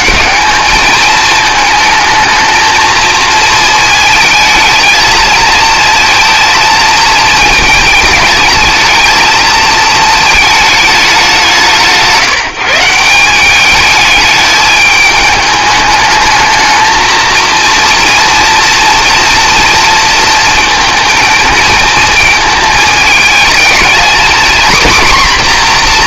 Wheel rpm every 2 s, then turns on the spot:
220, 220, 220, 220, 220, 220, 170, 210, 230, 230, 230, 220, 240.
none